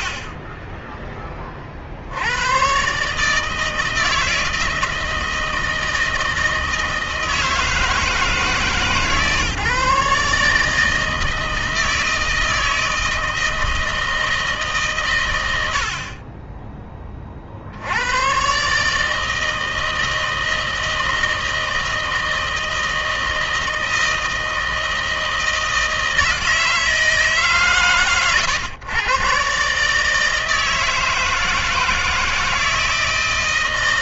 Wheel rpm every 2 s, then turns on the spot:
60, 120, 160, 160, 150, 160, 160, 150, 20, 140, 160, 160, 160, 160, 110, 160, 160.
none